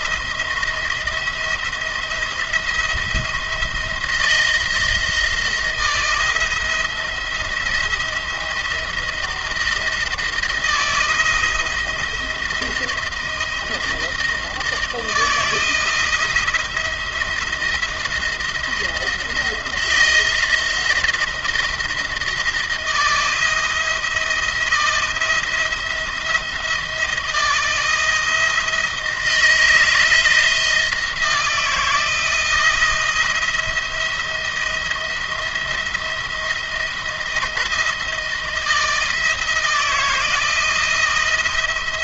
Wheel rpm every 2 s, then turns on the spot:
170, 170, 160, 170, 170, 170, 170, 160, 170, 170, 170, 170, 160, 160, 160, 160, 170, 170, 170, 160, 160.
none